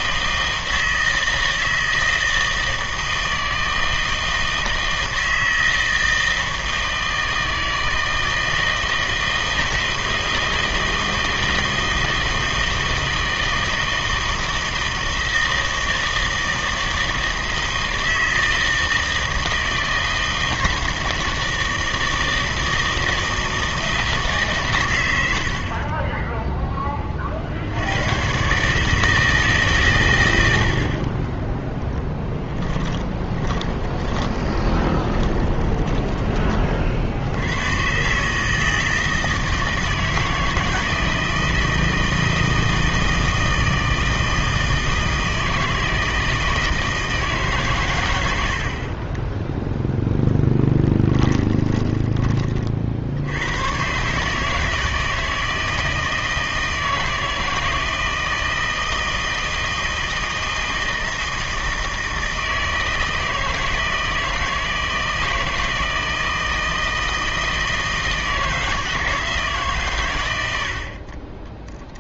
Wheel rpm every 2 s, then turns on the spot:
160, 160, 160, 160, 160, 160, 160, 160, 160, 160, 160, 160, 140, 10, 140, 80, 10, 20, 30, 160, 160, 160, 160, 160, 80, 10, 40, 160, 160, 160, 160, 160, 160, 160, 160, 80.
32-36 50-52